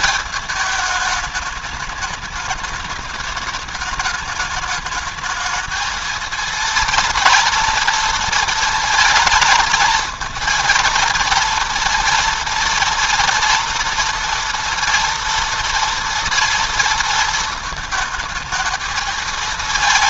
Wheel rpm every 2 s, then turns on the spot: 220, 210, 210, 230, 230, 230, 230, 230, 230, 220.
none